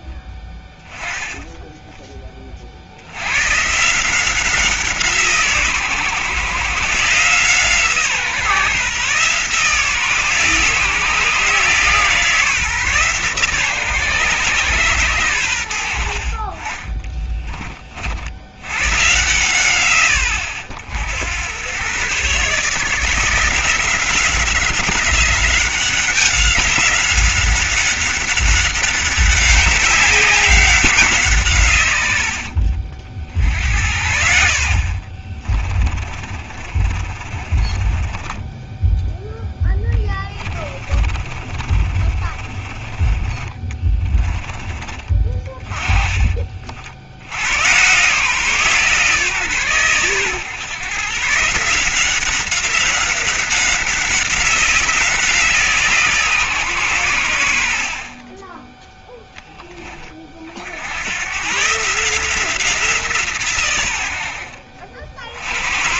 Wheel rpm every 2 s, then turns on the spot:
10, 70, 170, 140, 150, 150, 150, 130, 40, 120, 70, 160, 180, 190, 190, 190, 40, 60, 30, 10, 20, 20, 30, 60, 150, 140, 190, 180, 120, 10, 80, 170, 60.
36-38 40-42